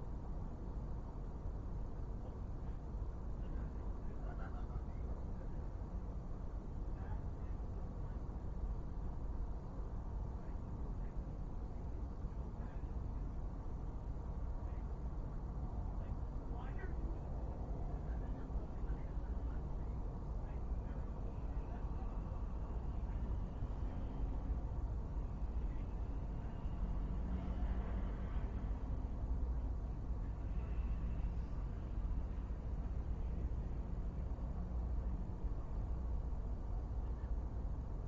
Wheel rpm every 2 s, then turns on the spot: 0, 0, 0, 0, 0, 0, 0, 0, 0, 0, 0, 0, 0, 0, 0, 0, 0, 0, 0.
none